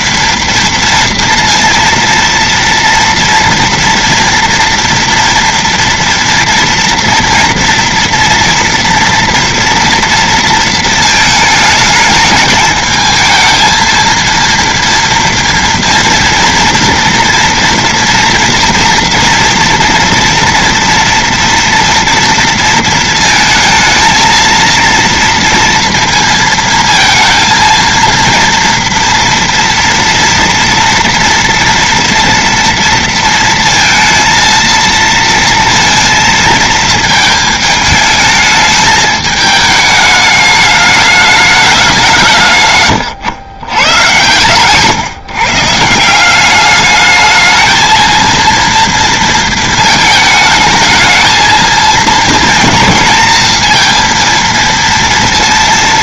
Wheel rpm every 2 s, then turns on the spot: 230, 230, 230, 240, 230, 230, 210, 230, 230, 230, 230, 230, 220, 230, 230, 230, 230, 230, 230, 220, 210, 170, 110, 170, 220, 220, 220, 230.
none